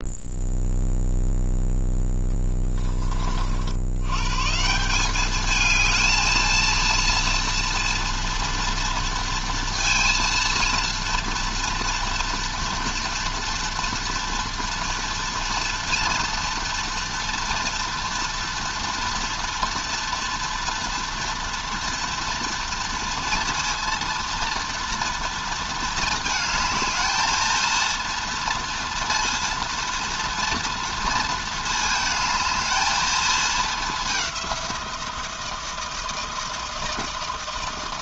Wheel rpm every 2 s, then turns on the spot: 0, 30, 200, 230, 230, 230, 230, 230, 230, 230, 230, 230, 230, 220, 230, 230, 220, 170, 160.
none